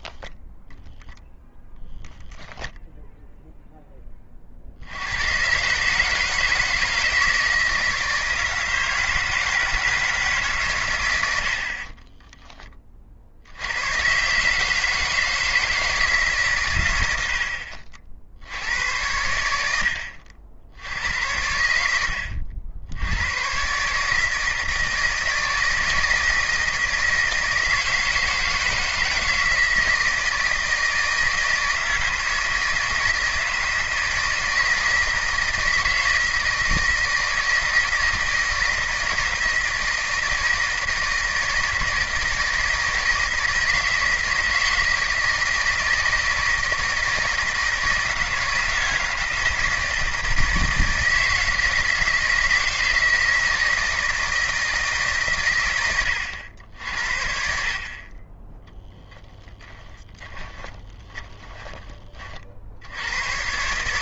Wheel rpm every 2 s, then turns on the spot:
0, 10, 80, 160, 160, 100, 40, 160, 100, 80, 90, 90, 160, 160, 160, 160, 160, 160, 160, 160, 160, 160, 160, 160, 160, 160, 160, 150, 60, 10, 30, 80.
58-62